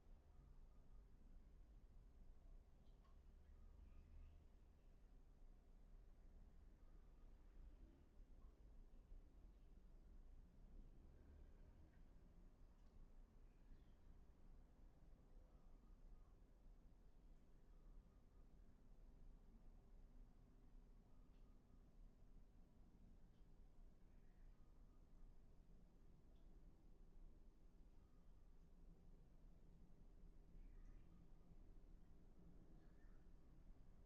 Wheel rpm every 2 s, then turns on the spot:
0, 0, 0, 0, 0, 0, 0, 0, 0, 0, 0, 0, 0, 0, 0, 0, 0.
none